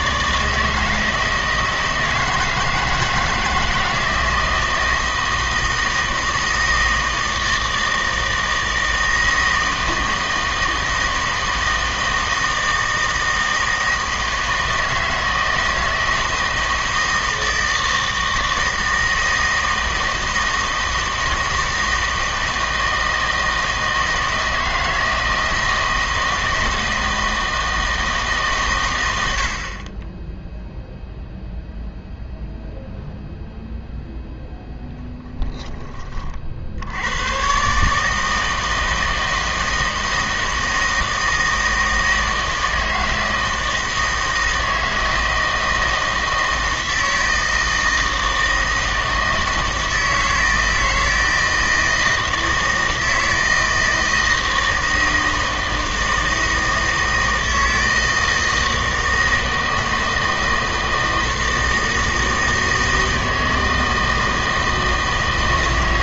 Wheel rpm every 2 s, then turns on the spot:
160, 160, 160, 160, 160, 160, 160, 160, 160, 160, 160, 160, 160, 160, 140, 0, 0, 0, 50, 160, 160, 160, 160, 160, 160, 160, 160, 160, 160, 160, 160, 160, 160.
none